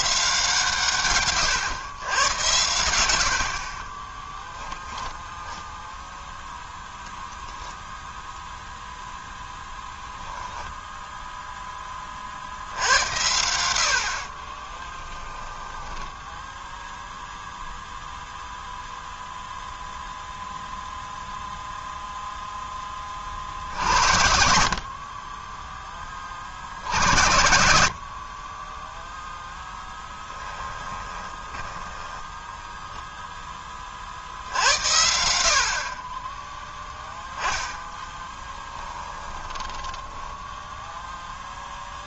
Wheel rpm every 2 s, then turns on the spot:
150, 90, 10, 0, 0, 10, 80, 10, 0, 0, 0, 10, 60, 60, 10, 10, 10, 70, 0, 20, 0.
4-6 10-12 14-16 30-34 38-40